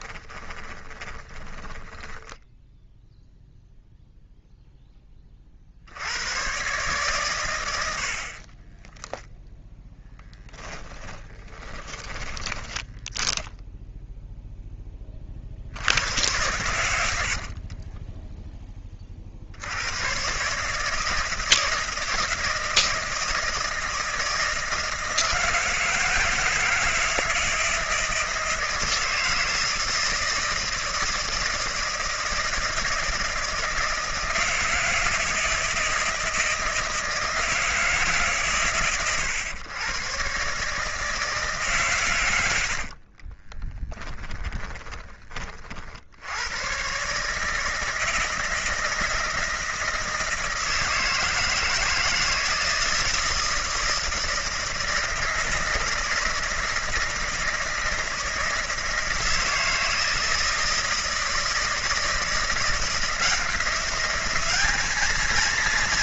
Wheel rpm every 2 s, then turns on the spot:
20, 0, 10, 130, 20, 40, 10, 10, 90, 20, 150, 160, 160, 170, 160, 160, 160, 160, 160, 120, 150, 70, 20, 120, 160, 160, 160, 160, 160, 160, 160, 170, 210.
0-2 8-14 42-46